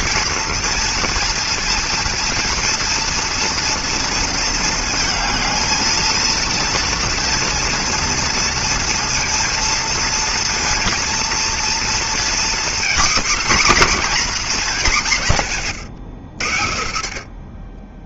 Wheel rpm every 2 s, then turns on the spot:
230, 230, 230, 230, 230, 230, 230, 210, 100.
none